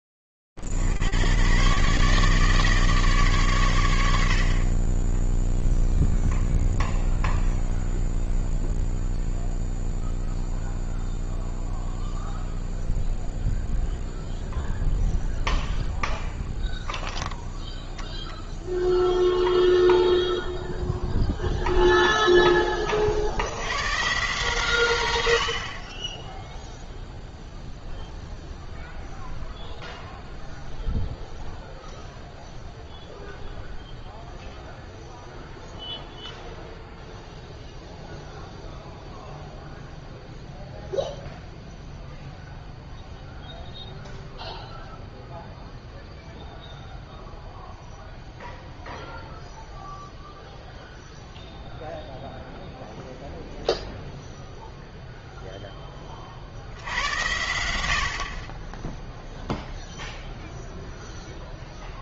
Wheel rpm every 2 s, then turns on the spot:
30, 150, 60, 0, 0, 0, 0, 0, 0, 0, 0, 60, 90, 0, 0, 0, 0, 0, 0, 0, 0, 0, 0, 0, 0, 0, 0, 10, 80, 0, 0.
none